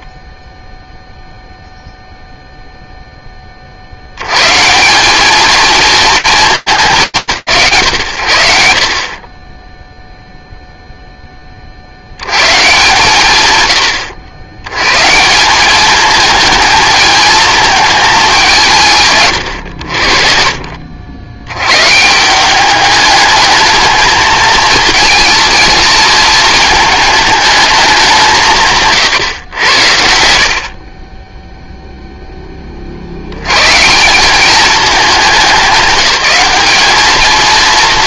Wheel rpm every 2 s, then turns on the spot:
10, 0, 180, 160, 70, 0, 140, 140, 220, 140, 70, 210, 230, 220, 160, 30, 80, 210, 210.
none